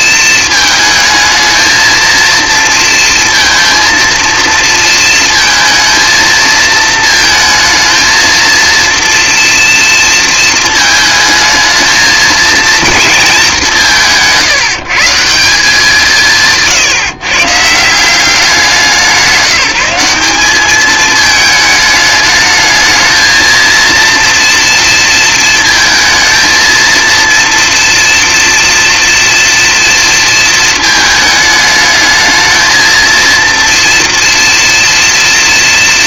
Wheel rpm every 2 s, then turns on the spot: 220, 230, 230, 220, 230, 220, 230, 160, 160, 180, 210, 220, 230, 230, 230, 220, 220, 230.
none